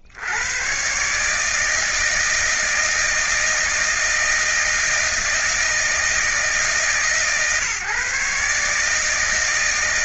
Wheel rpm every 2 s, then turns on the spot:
100, 160, 160, 160, 140.
none